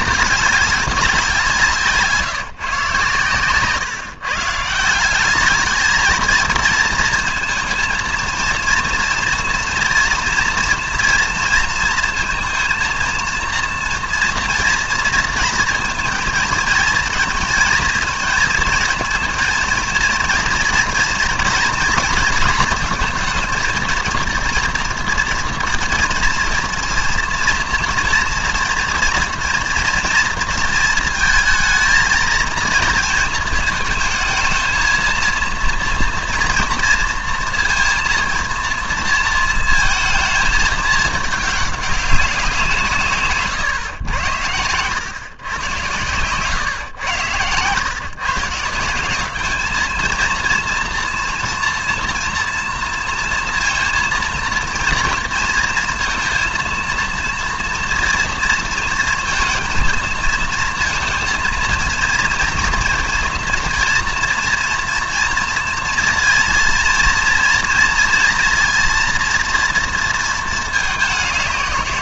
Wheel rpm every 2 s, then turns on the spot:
200, 140, 160, 230, 230, 230, 230, 230, 230, 230, 240, 230, 230, 230, 230, 230, 220, 220, 230, 230, 220, 180, 100, 130, 160, 230, 230, 230, 230, 230, 230, 230, 230, 230, 230, 210.
none